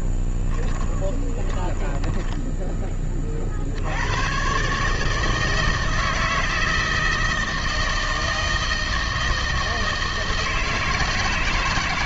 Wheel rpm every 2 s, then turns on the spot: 10, 20, 70, 160, 160, 160.
0-4